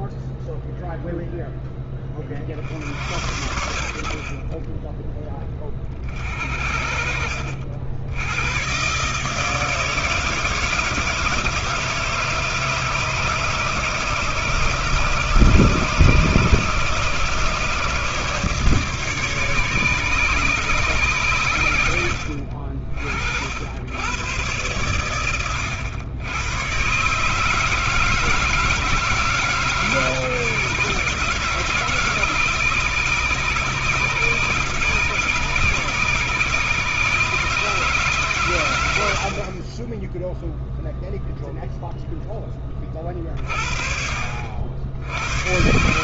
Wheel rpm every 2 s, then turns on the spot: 0, 60, 40, 50, 110, 160, 150, 150, 140, 150, 140, 70, 110, 100, 160, 150, 150, 140, 140, 120, 0, 10, 70.
4-6